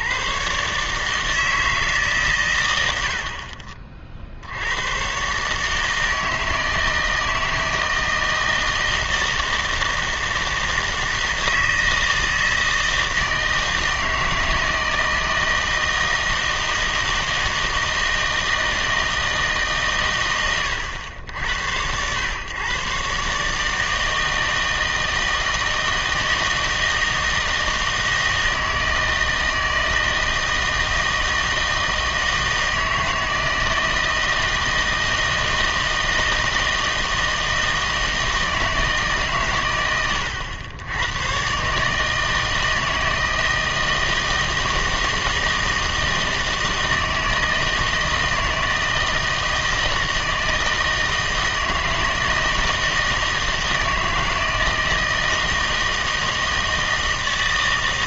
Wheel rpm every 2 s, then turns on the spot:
150, 100, 90, 160, 160, 160, 160, 160, 160, 160, 100, 130, 160, 160, 160, 160, 160, 160, 160, 160, 90, 160, 160, 160, 160, 160, 160, 160, 160.
none